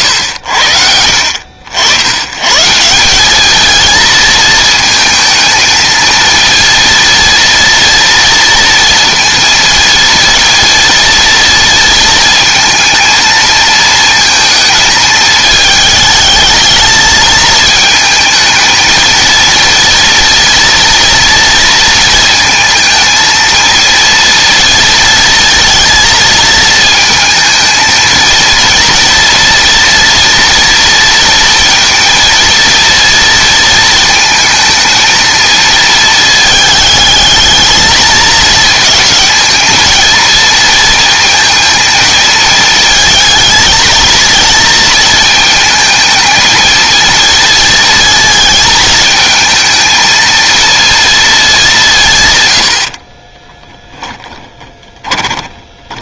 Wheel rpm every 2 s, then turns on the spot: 90, 140, 220, 230, 230, 230, 230, 220, 220, 230, 230, 230, 230, 220, 230, 230, 230, 230, 220, 220, 230, 220, 220, 230, 220, 230, 110, 10.
54-56